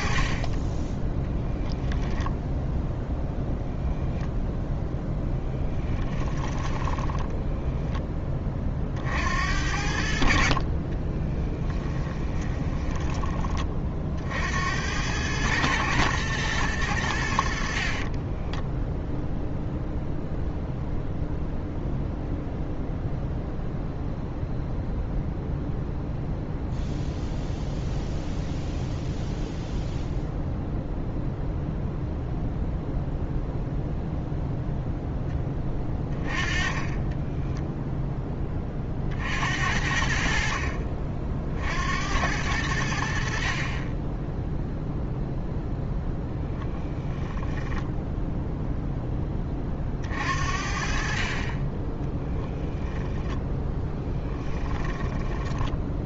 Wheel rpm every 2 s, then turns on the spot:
20, 10, 10, 20, 40, 30, 10, 80, 100, 10, 0, 0, 0, 0, 0, 0, 0, 0, 20, 30, 50, 80, 0, 10, 0, 50, 0, 10.
6-8 12-14 18-20 46-48 54-56